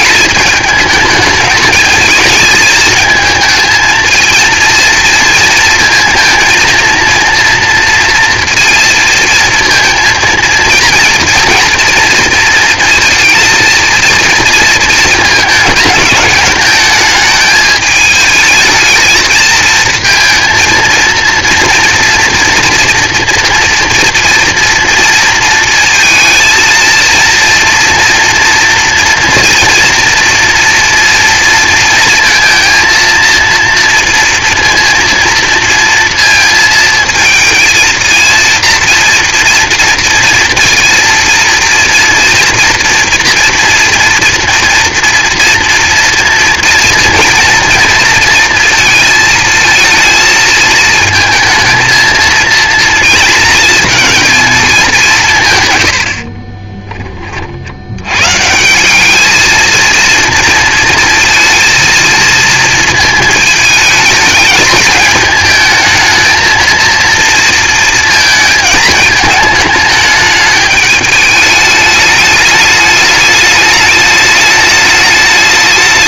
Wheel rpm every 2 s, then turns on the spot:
220, 220, 230, 230, 230, 230, 230, 230, 210, 220, 230, 240, 230, 230, 230, 230, 230, 230, 230, 230, 230, 230, 230, 230, 230, 220, 230, 210, 30, 170, 230, 230, 210, 230, 220, 210, 210, 210.
56-58